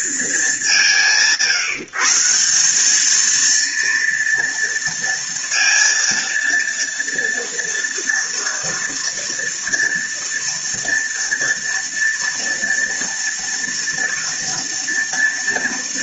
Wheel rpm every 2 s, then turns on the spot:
190, 190, 230, 230, 230, 230, 230, 240.
none